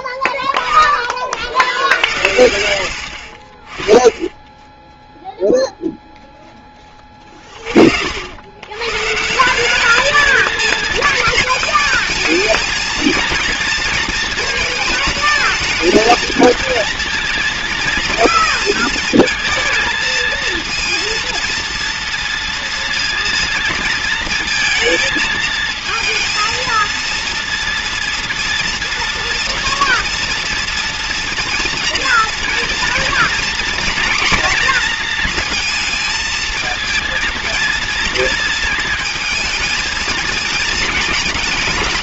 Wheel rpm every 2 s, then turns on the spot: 20, 70, 10, 10, 110, 220, 220, 220, 220, 220, 230, 230, 220, 230, 230, 230, 230, 240, 220, 220, 220.
none